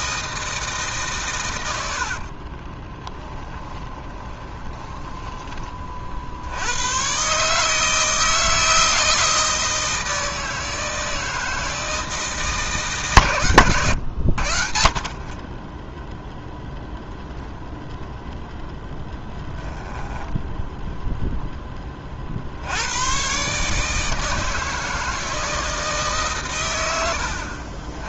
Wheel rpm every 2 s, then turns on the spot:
160, 30, 20, 100, 160, 160, 150, 60, 0, 0, 0, 90, 160, 90.
2-6